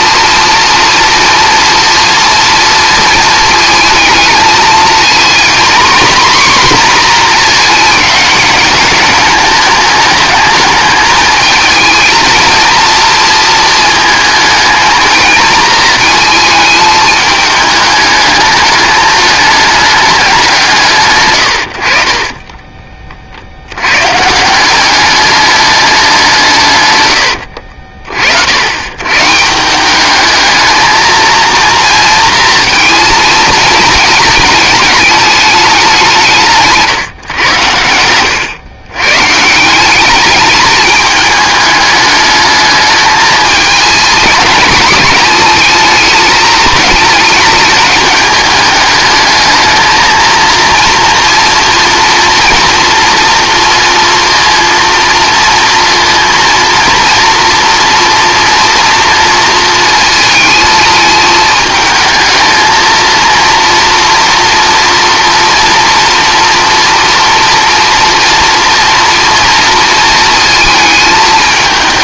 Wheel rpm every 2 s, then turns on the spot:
230, 230, 220, 250, 210, 210, 230, 220, 220, 210, 170, 30, 170, 140, 80, 220, 230, 210, 150, 100, 210, 210, 220, 220, 210, 230, 230, 230, 230, 230, 220, 220, 230, 230, 240, 220.
22-24